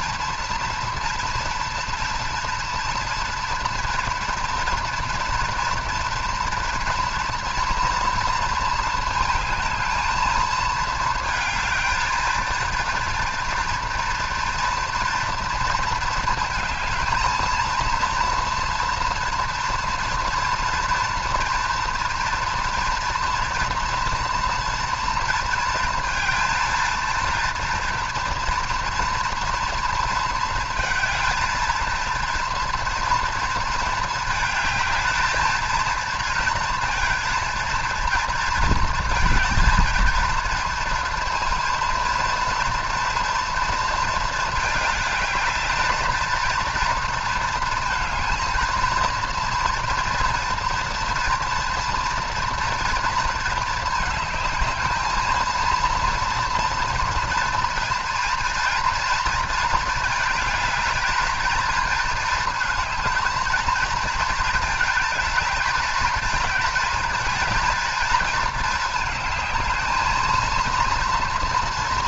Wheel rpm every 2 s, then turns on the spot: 230, 240, 230, 230, 230, 220, 230, 230, 220, 230, 230, 230, 230, 230, 230, 220, 230, 220, 230, 220, 230, 230, 220, 220, 230, 230, 240, 220, 240, 240, 220, 220, 220, 220, 230, 230.
none